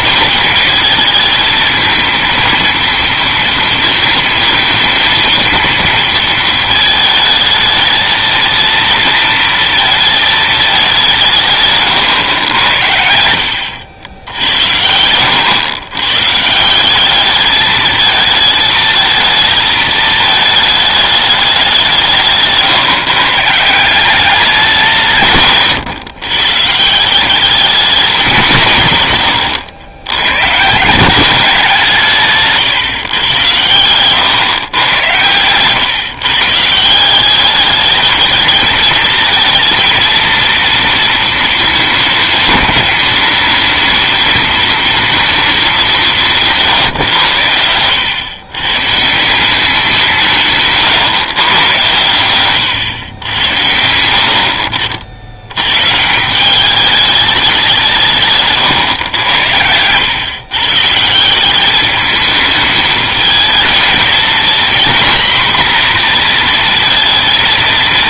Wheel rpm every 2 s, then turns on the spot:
220, 230, 220, 220, 230, 210, 90, 80, 170, 220, 220, 150, 180, 130, 180, 140, 140, 120, 150, 220, 230, 210, 220, 160, 110, 150, 120, 60, 190, 150, 130, 210, 240, 230.
52-54 58-60